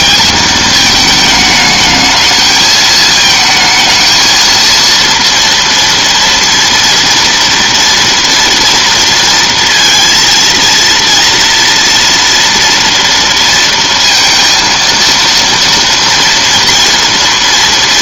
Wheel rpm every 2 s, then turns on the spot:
220, 220, 230, 230, 230, 230, 230, 230, 240.
none